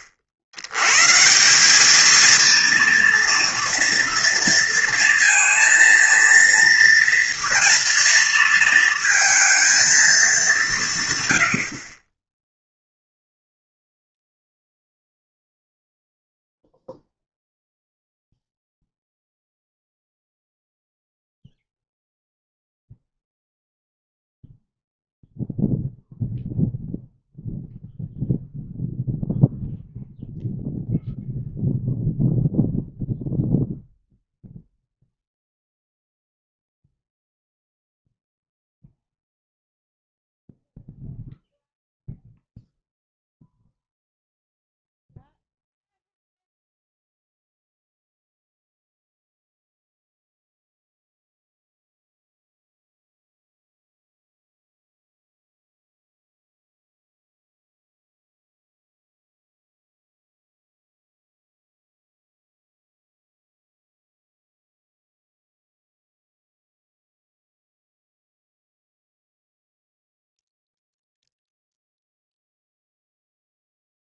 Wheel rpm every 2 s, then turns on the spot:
80, 230, 230, 230, 230, 180, 0, 0, 0, 0, 0, 0, 0, 0, 0, 0, 0, 0, 0, 0, 0, 0, 0, 0, 0, 0, 0, 0, 0, 0, 0, 0, 0, 0, 0, 0, 0.
none